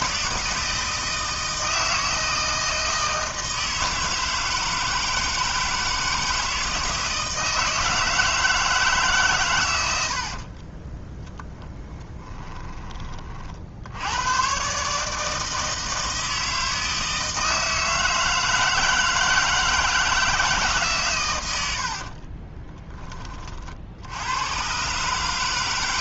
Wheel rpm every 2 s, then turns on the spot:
160, 160, 160, 160, 160, 30, 30, 130, 160, 160, 140, 20, 120.
10-14 22-24